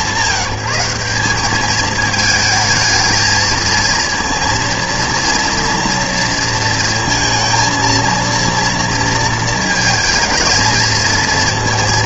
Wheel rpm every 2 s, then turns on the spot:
180, 220, 230, 230, 230, 230.
none